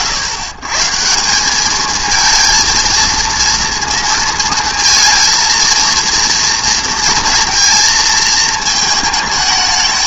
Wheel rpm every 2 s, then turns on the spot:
130, 220, 230, 230, 220.
none